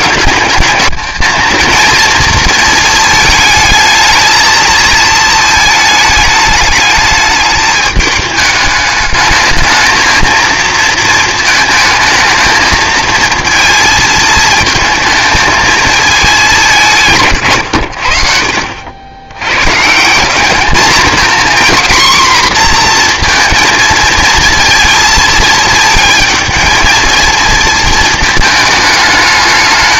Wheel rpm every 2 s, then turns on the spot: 200, 230, 220, 210, 210, 230, 220, 220, 180, 70, 220, 250, 230, 220, 220.
none